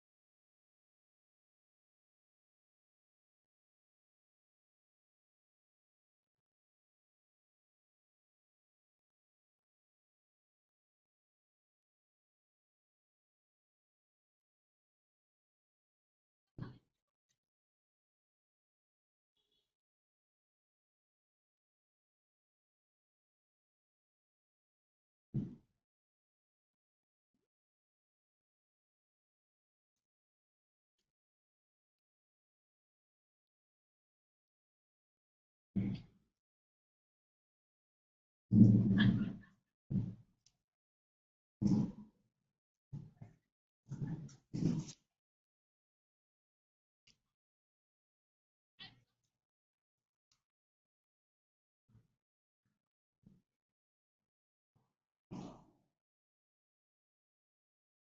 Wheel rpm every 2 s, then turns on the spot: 0, 0, 0, 0, 0, 0, 0, 0, 0, 0, 0, 0, 0, 0, 0, 0, 0, 0, 0, 0, 0, 0, 0, 0, 0, 0, 0, 0, 0.
none